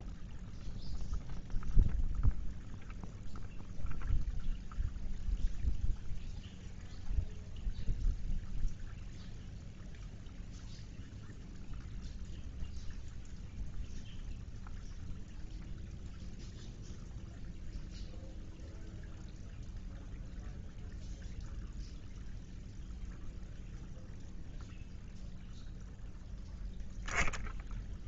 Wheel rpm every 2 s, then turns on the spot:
0, 0, 0, 0, 0, 0, 0, 0, 0, 0, 0, 0, 0, 0.
none